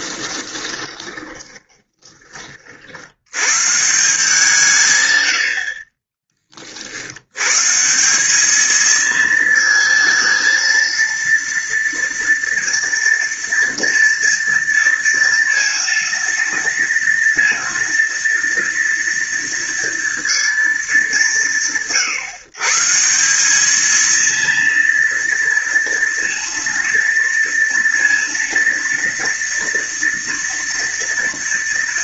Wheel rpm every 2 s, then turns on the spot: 20, 60, 140, 40, 220, 230, 230, 230, 230, 230, 190, 160, 230, 230, 230, 230.
0-2